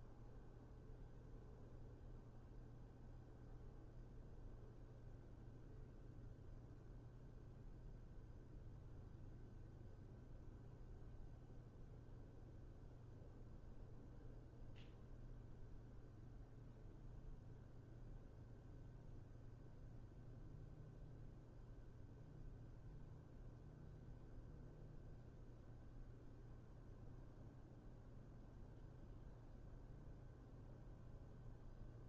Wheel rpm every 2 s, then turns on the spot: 0, 0, 0, 0, 0, 0, 0, 0, 0, 0, 0, 0, 0, 0, 0, 0.
none